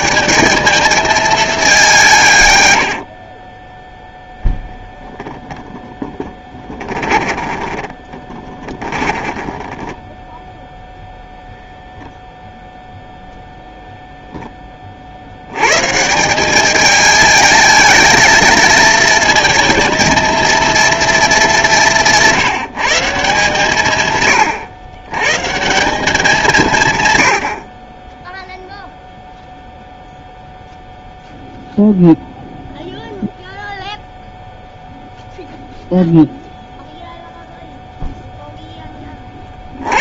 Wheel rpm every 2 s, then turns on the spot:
220, 80, 0, 20, 20, 0, 0, 20, 200, 230, 230, 170, 120, 150, 0, 0, 0, 0, 0, 10.
2-4 6-10